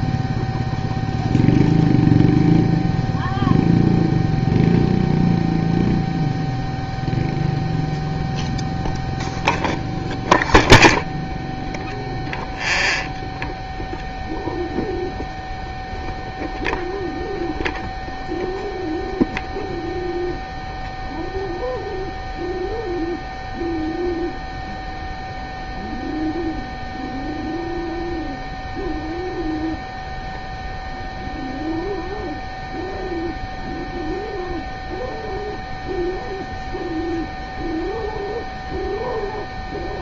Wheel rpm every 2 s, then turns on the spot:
0, 0, 0, 0, 0, 0, 0, 0, 0, 0, 0, 0, 0, 0, 0, 0, 0, 0, 0, 0.
none